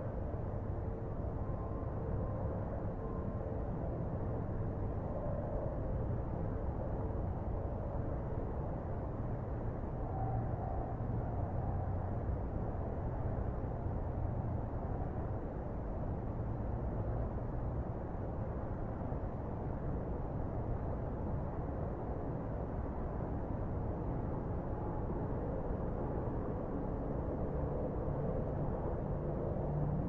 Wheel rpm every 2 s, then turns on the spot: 0, 0, 0, 0, 0, 0, 0, 0, 0, 0, 0, 0, 0, 0, 0.
none